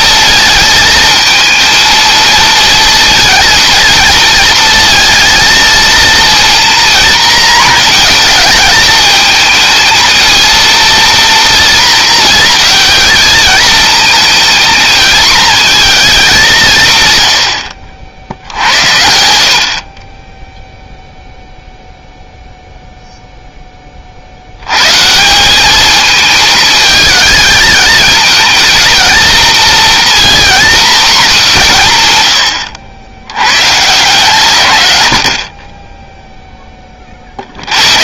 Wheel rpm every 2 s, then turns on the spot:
220, 230, 230, 230, 220, 230, 220, 230, 140, 90, 0, 0, 130, 220, 230, 250, 90, 110, 30.
none